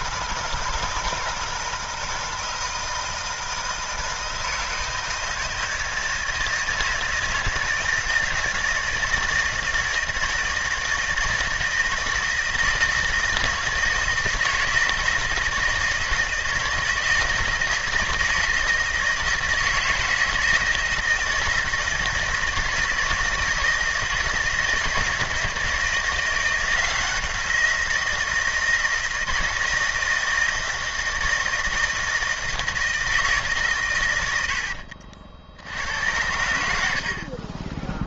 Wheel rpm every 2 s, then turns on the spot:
160, 160, 160, 160, 160, 160, 160, 160, 160, 160, 160, 170, 160, 170, 170, 160, 160, 70, 80.
34-36